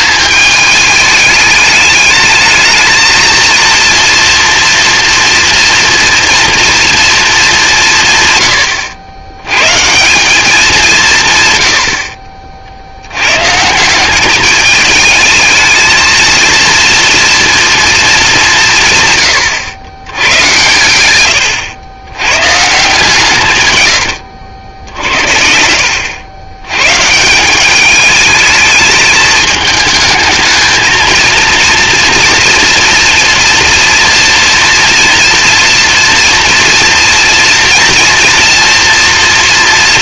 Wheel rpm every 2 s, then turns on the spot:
210, 220, 230, 230, 120, 190, 60, 210, 230, 170, 110, 160, 70, 110, 220, 230, 240, 230, 230, 240.
none